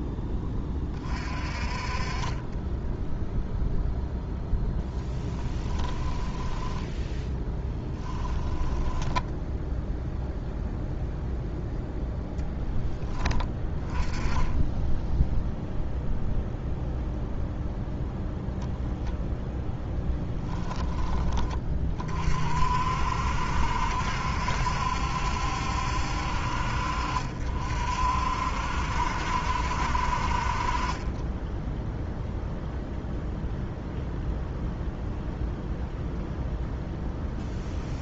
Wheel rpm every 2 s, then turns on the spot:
20, 10, 0, 10, 10, 0, 10, 10, 0, 0, 20, 60, 70, 60, 70, 30, 0, 0, 0.
6-10 20-22